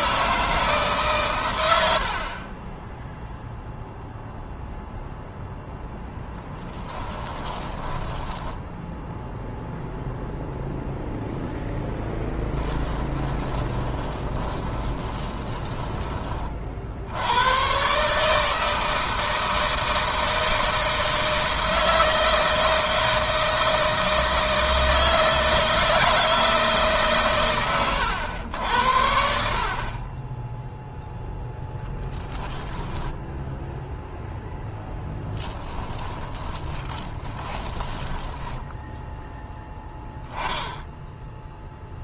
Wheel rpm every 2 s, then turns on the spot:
150, 10, 0, 20, 10, 0, 10, 20, 70, 160, 160, 160, 160, 140, 70, 0, 10, 10, 30, 10, 10.
6-10 12-16 34-38